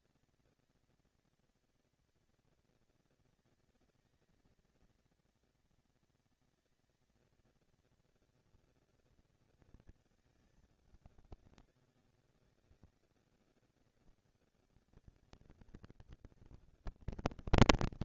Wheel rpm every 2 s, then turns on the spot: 230, 230, 230, 230, 240, 220, 190, 200, 230.
none